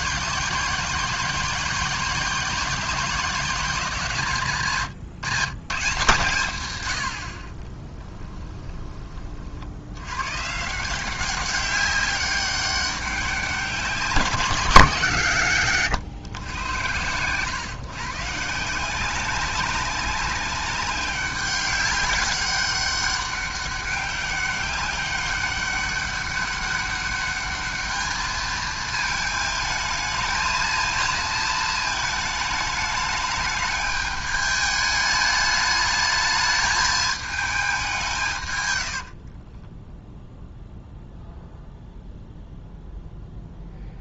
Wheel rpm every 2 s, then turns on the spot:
170, 180, 110, 90, 20, 160, 200, 160, 100, 170, 190, 200, 200, 200, 220, 230, 210, 210, 210, 90, 0, 0.
38-40